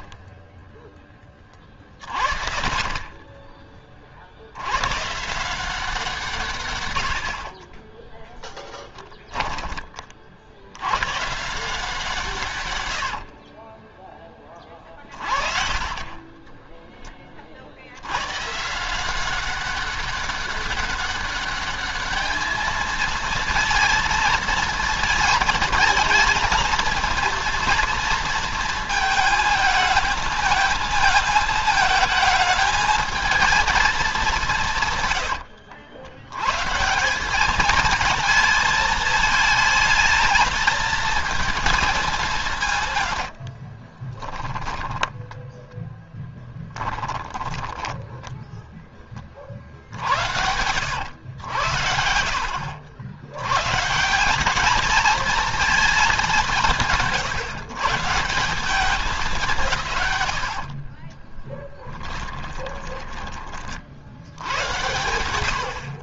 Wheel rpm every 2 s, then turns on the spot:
30, 140, 60, 0, 110, 90, 30, 10, 140, 200, 220, 220, 220, 230, 220, 220, 150, 120, 220, 220, 160, 10, 10, 10, 60, 70, 140, 220, 150, 110, 10, 50, 70.
10-16 40-48 60-62